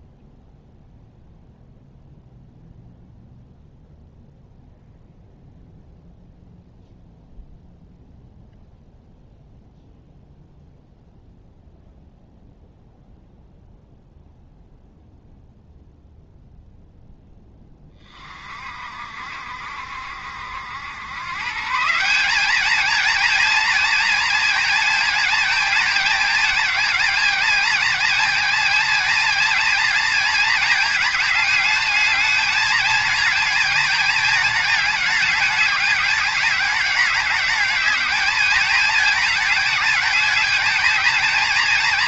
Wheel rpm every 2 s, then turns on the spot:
0, 0, 0, 0, 0, 0, 0, 0, 0, 50, 100, 220, 220, 220, 220, 220, 220, 220, 210, 210, 220.
none